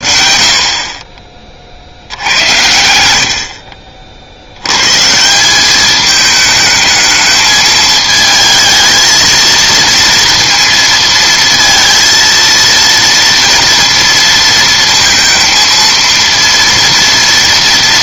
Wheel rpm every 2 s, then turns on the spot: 50, 80, 110, 220, 220, 230, 230, 230, 230.
none